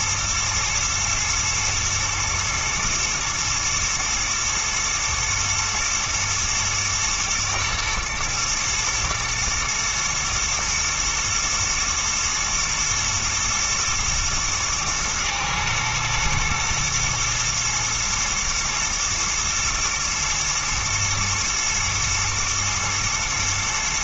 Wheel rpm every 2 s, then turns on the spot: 110, 120, 110, 110, 120, 120, 120, 110, 120, 120, 110, 110.
none